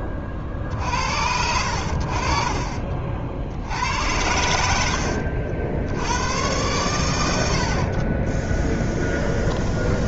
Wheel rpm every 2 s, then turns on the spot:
30, 50, 70, 110, 10.
8-10